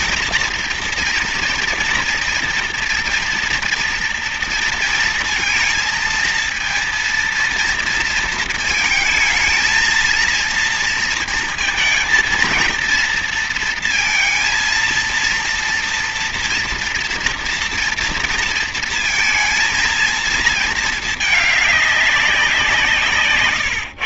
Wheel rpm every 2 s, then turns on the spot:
240, 240, 230, 230, 230, 230, 230, 230, 230, 230, 230, 200.
none